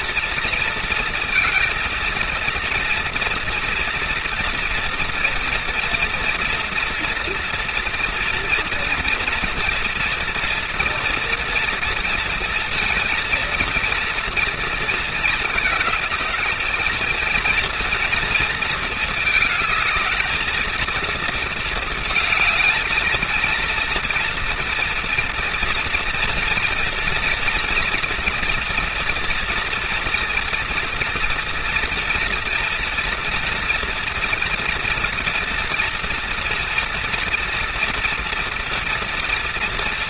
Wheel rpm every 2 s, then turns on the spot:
230, 230, 230, 230, 230, 230, 230, 230, 220, 230, 220, 220, 240, 230, 230, 240, 230, 230, 230, 230.
none